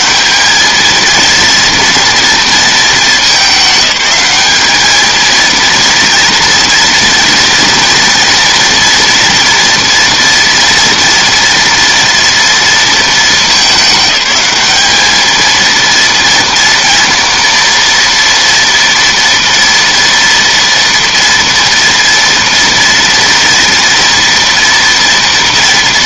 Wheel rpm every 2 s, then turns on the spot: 230, 220, 220, 230, 230, 230, 220, 220, 230, 230, 230, 230, 230.
none